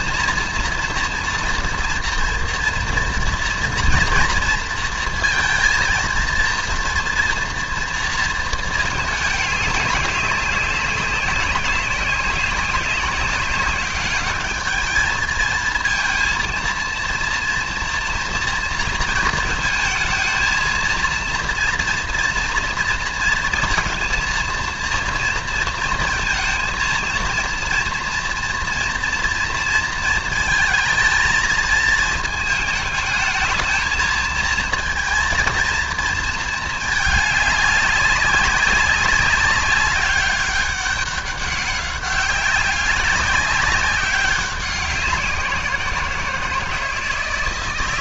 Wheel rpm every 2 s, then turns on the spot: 230, 240, 230, 240, 220, 200, 190, 210, 230, 220, 230, 230, 230, 230, 240, 220, 220, 230, 220, 200, 200, 200, 190, 160.
none